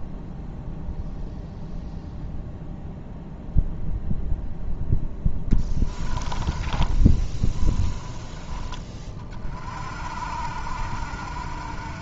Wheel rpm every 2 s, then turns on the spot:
0, 0, 0, 20, 20, 60.
6-8